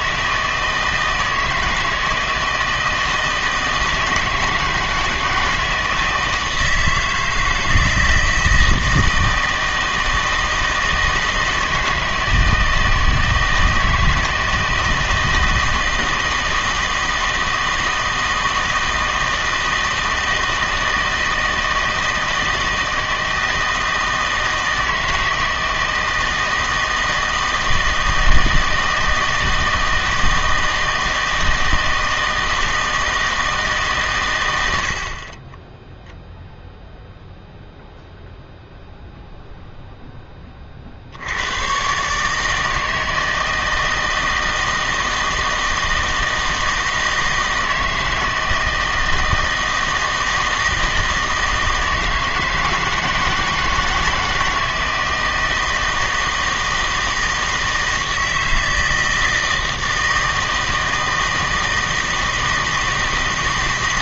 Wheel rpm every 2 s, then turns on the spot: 160, 160, 160, 160, 160, 160, 160, 160, 160, 160, 160, 160, 160, 160, 160, 160, 160, 80, 10, 0, 30, 160, 160, 160, 160, 160, 160, 160, 160, 160, 160, 160.
none